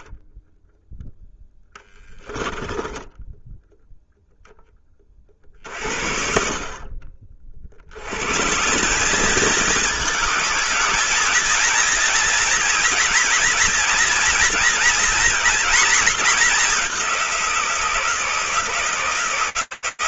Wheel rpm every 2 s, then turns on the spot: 0, 10, 10, 40, 190, 220, 230, 230, 200, 170.
2-4